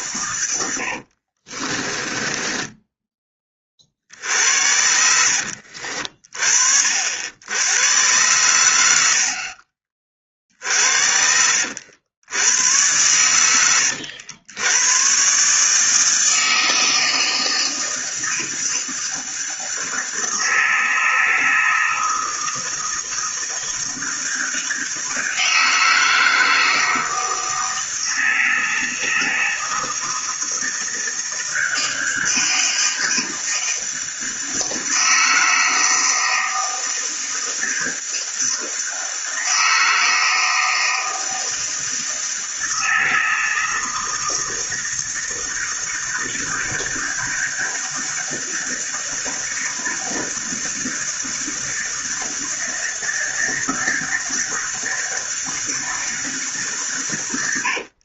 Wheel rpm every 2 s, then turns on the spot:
80, 10, 70, 60, 90, 60, 100, 100, 160, 160, 160, 160, 160, 160, 160, 160, 160, 160, 160, 160, 160, 160, 160, 160, 160, 160, 160, 160, 130.
0-2